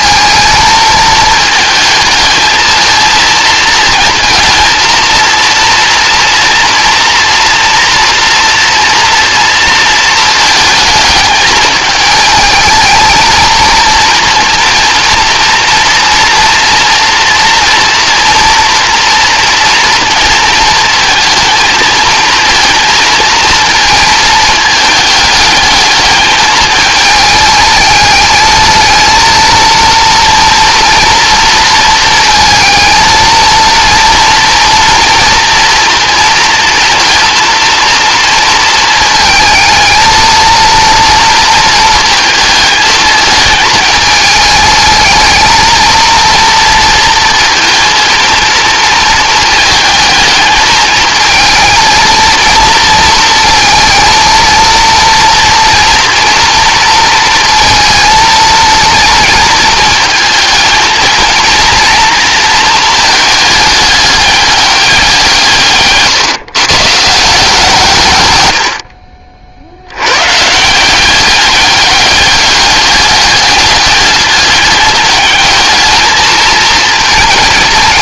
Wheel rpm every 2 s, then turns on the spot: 220, 220, 230, 230, 230, 220, 220, 230, 230, 230, 230, 230, 210, 220, 230, 230, 230, 230, 230, 230, 230, 220, 220, 230, 220, 220, 230, 230, 230, 230, 230, 220, 180, 150, 50, 170, 200, 200, 220.
none